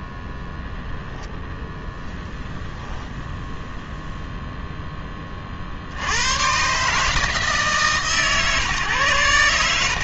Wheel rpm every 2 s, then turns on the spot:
0, 0, 0, 130, 130.
none